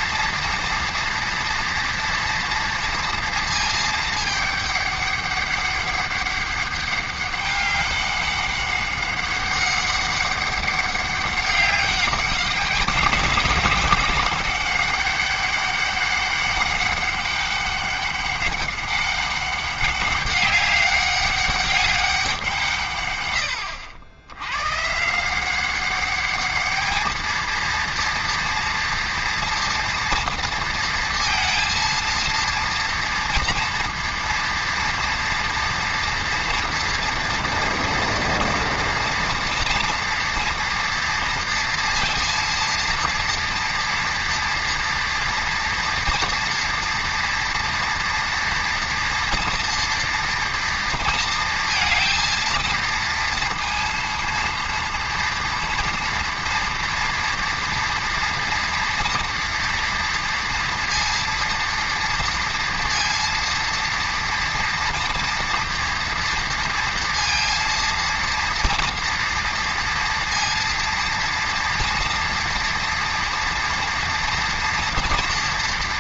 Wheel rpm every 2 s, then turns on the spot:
230, 230, 210, 200, 200, 200, 200, 200, 200, 200, 200, 170, 110, 210, 230, 230, 230, 230, 240, 230, 230, 230, 230, 230, 230, 230, 230, 230, 230, 230, 230, 230, 230, 230, 230, 230, 230, 230.
none